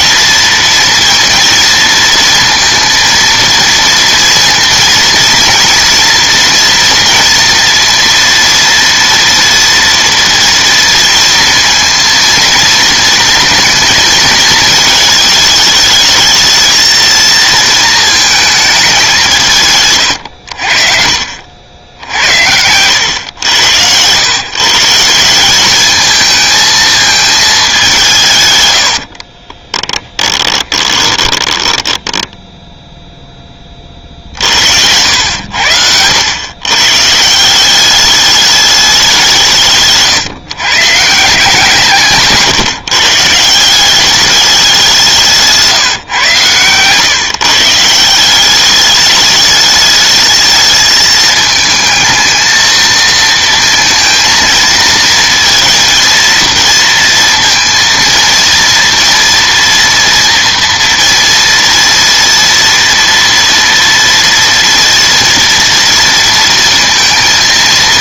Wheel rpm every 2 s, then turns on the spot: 230, 230, 230, 230, 230, 230, 230, 220, 230, 210, 60, 100, 150, 220, 110, 20, 0, 70, 130, 210, 140, 150, 190, 130, 200, 220, 220, 230, 230, 230, 230, 230, 230, 230.
28-32 46-48